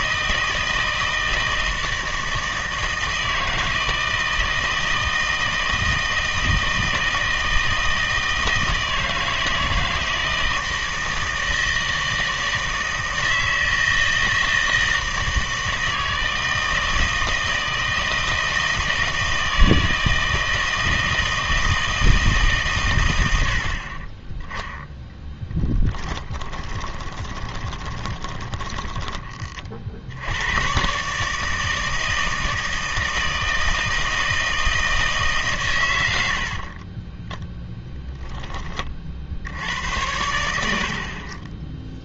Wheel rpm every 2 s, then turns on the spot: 160, 160, 160, 160, 160, 160, 160, 160, 160, 160, 160, 130, 0, 20, 20, 130, 160, 160, 30, 30, 80.
26-30 36-38